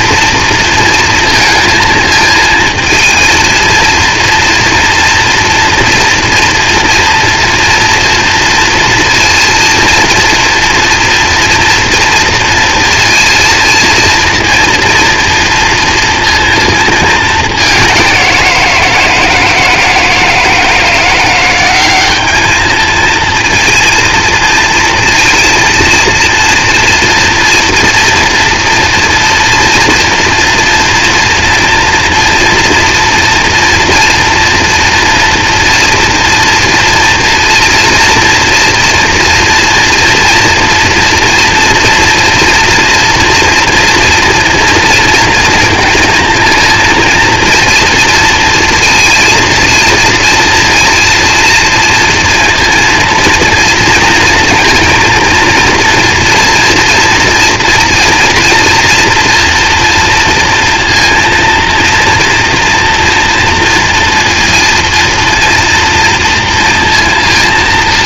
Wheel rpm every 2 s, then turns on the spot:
230, 230, 230, 240, 230, 230, 230, 230, 220, 170, 170, 220, 230, 230, 230, 230, 230, 240, 230, 230, 230, 230, 230, 230, 230, 230, 230, 230, 230, 230, 230, 230, 230, 230.
none